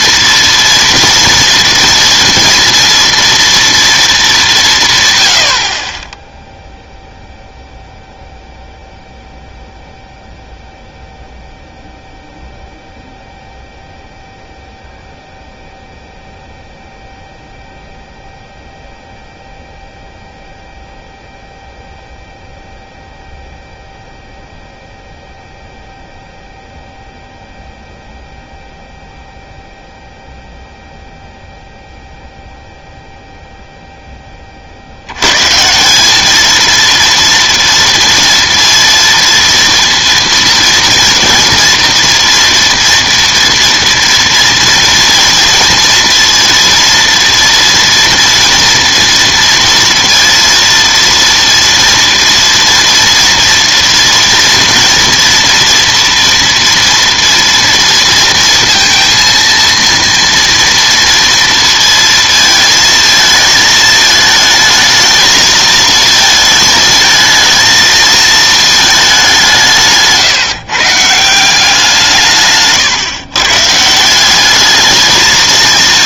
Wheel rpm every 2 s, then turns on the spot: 240, 230, 170, 0, 0, 0, 0, 0, 0, 0, 0, 0, 0, 0, 0, 0, 0, 50, 230, 230, 230, 230, 230, 230, 230, 230, 230, 230, 230, 230, 230, 230, 220, 220, 220, 140, 140, 210.
none